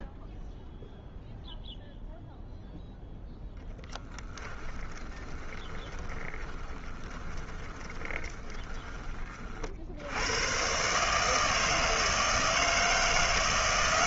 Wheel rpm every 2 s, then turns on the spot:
0, 0, 20, 10, 10, 130, 160.
4-8